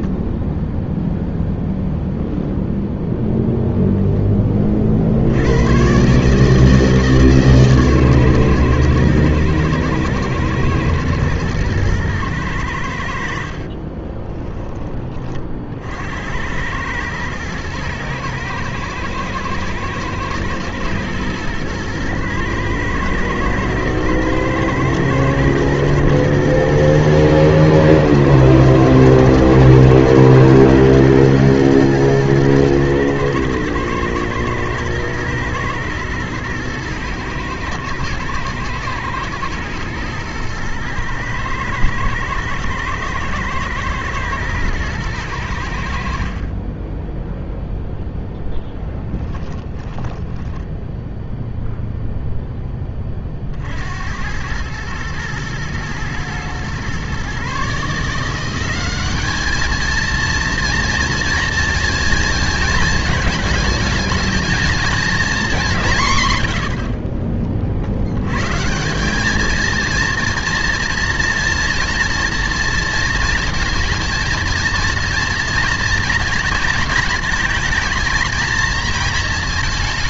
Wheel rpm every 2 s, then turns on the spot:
0, 0, 30, 150, 120, 120, 100, 20, 90, 110, 110, 120, 120, 120, 110, 120, 110, 110, 110, 110, 110, 110, 110, 40, 0, 10, 10, 100, 120, 180, 230, 220, 220, 100, 140, 230, 230, 230, 230, 230.
46-48 50-52